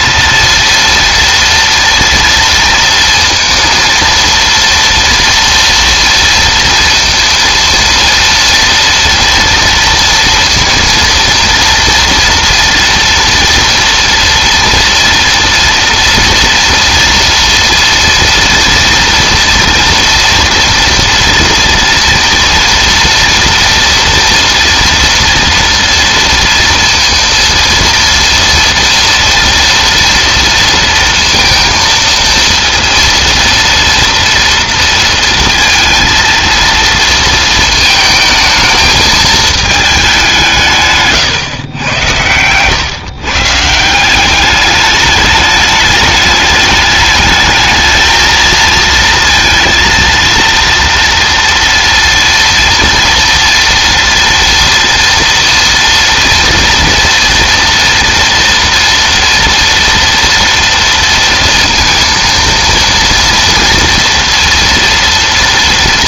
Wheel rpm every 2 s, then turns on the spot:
230, 230, 230, 230, 230, 230, 230, 230, 230, 230, 230, 230, 230, 230, 230, 230, 230, 230, 230, 220, 150, 120, 200, 210, 230, 230, 230, 230, 230, 240, 230, 230, 230.
none